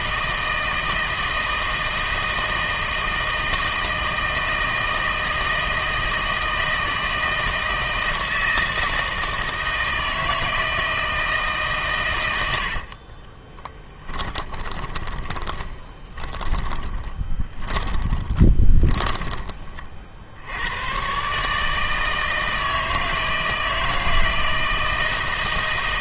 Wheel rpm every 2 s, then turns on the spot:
160, 160, 160, 160, 160, 160, 80, 20, 20, 20, 90, 160, 160.
12-20